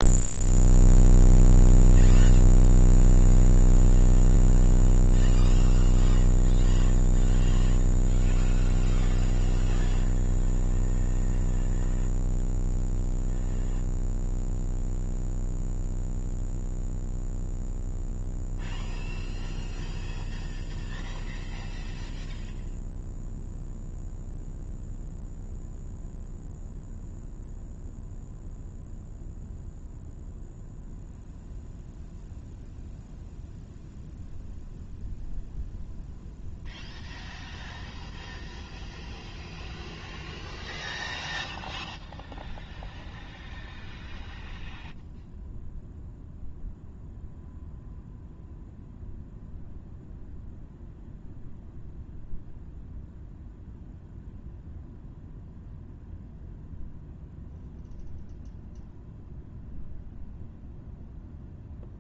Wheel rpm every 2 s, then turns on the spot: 0, 0, 0, 0, 0, 0, 0, 0, 0, 0, 0, 0, 0, 0, 0, 0, 0, 0, 0, 0, 0, 0, 0, 0, 0, 0, 0, 0, 0, 0, 0.
none